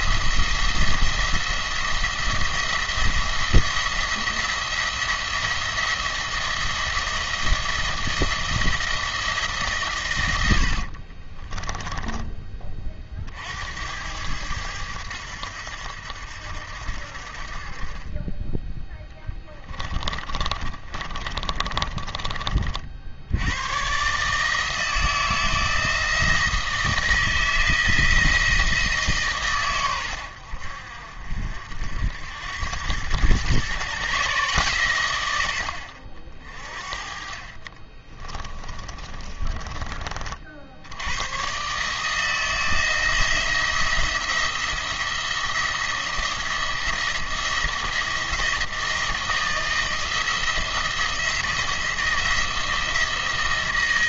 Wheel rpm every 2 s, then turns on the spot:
170, 170, 170, 170, 160, 70, 30, 100, 70, 10, 20, 50, 160, 160, 160, 70, 100, 130, 40, 30, 60, 160, 170, 160, 160, 170, 170.
10-12 20-22 38-40